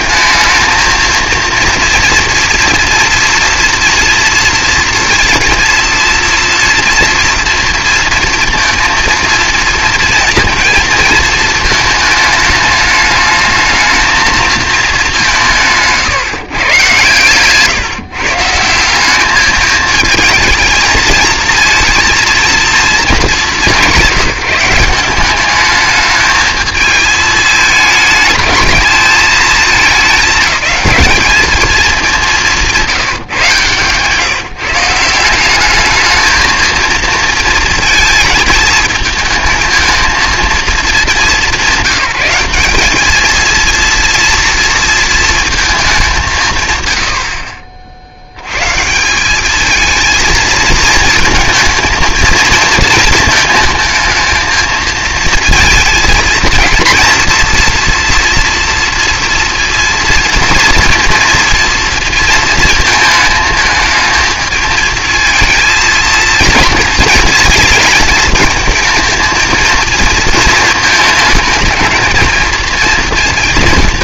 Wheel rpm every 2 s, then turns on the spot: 220, 230, 230, 230, 230, 230, 210, 210, 130, 160, 220, 230, 180, 220, 220, 220, 180, 150, 220, 220, 220, 200, 230, 120, 120, 220, 220, 220, 220, 230, 230, 230, 220, 230, 220, 230, 230.
32-34